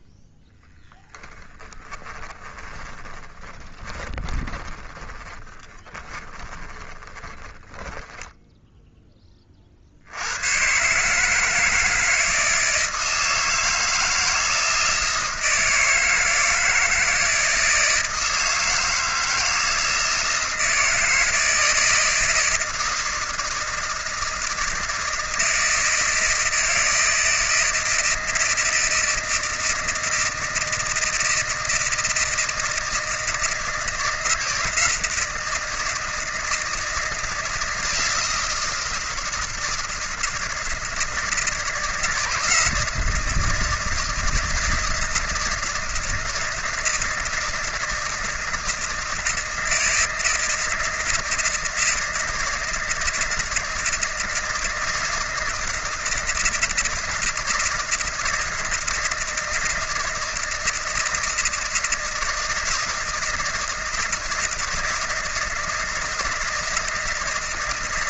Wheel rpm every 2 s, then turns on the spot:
10, 20, 30, 20, 10, 120, 160, 160, 160, 160, 170, 160, 160, 160, 160, 160, 160, 160, 170, 160, 160, 170, 160, 160, 160, 160, 160, 160, 160, 160, 160, 160, 160, 160.
0-8